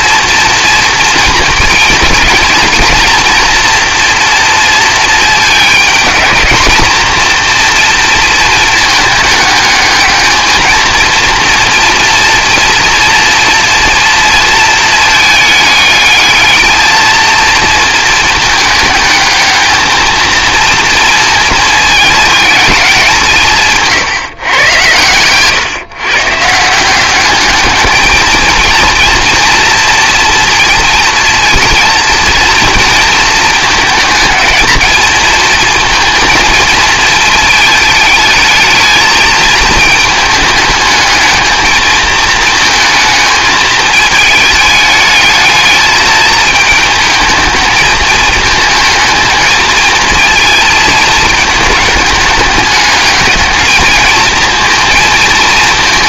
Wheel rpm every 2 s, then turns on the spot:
230, 230, 220, 230, 220, 220, 230, 220, 220, 220, 230, 210, 120, 180, 230, 230, 230, 220, 220, 220, 210, 220, 210, 220, 230, 220, 210, 230.
none